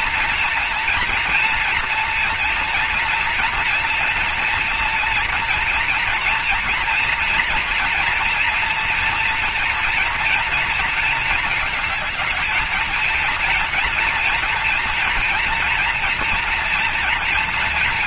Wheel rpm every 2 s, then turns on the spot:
230, 230, 230, 230, 230, 230, 220, 230, 230.
none